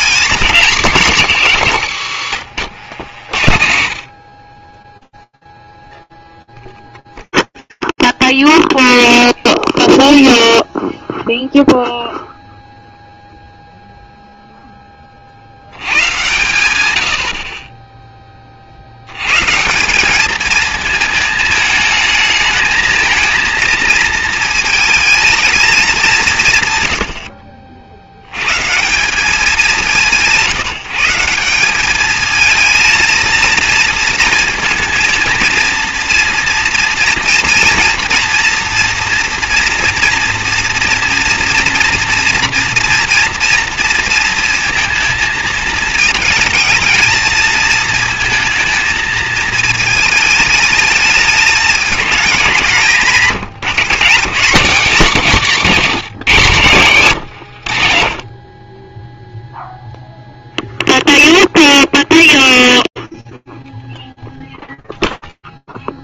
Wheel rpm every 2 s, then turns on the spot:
220, 100, 10, 0, 0, 0, 0, 90, 30, 150, 220, 230, 210, 60, 190, 190, 230, 230, 230, 240, 240, 230, 220, 230, 220, 220, 170, 200, 100, 0, 0, 0, 0.
2-4 56-58